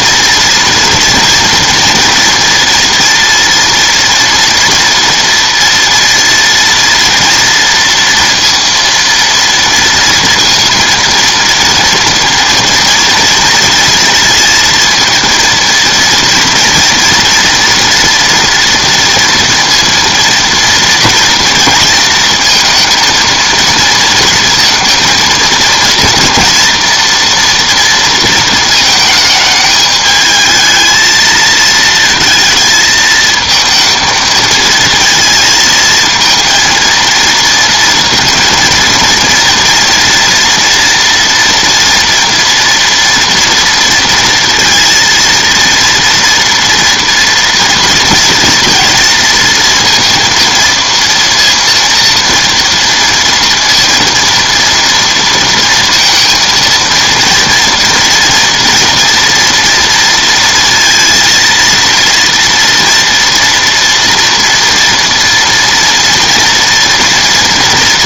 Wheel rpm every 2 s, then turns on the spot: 240, 230, 230, 230, 230, 230, 230, 230, 230, 230, 230, 230, 230, 240, 220, 220, 220, 220, 230, 230, 230, 240, 230, 230, 230, 230, 230, 230, 230, 230, 230, 230, 230, 230.
none